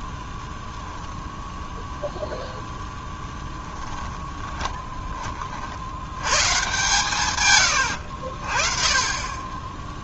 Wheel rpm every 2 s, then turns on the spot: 0, 0, 20, 130, 40.
4-6